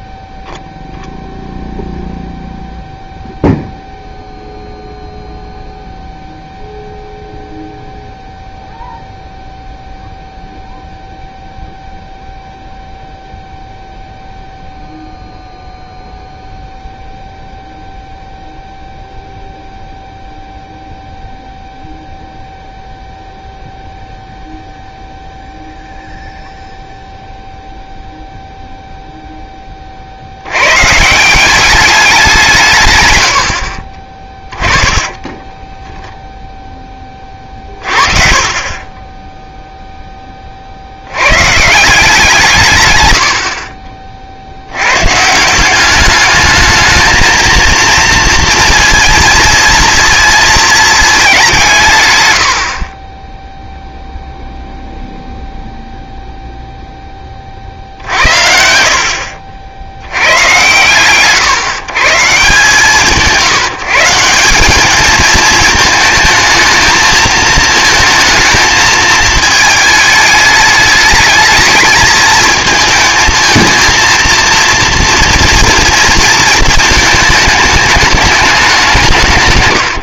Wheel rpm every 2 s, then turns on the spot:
0, 0, 0, 0, 0, 0, 0, 0, 0, 0, 0, 0, 0, 0, 0, 110, 160, 20, 10, 20, 50, 140, 90, 210, 230, 220, 50, 0, 0, 50, 80, 160, 200, 230, 220, 210, 220, 230, 220, 190.
34-36 38-40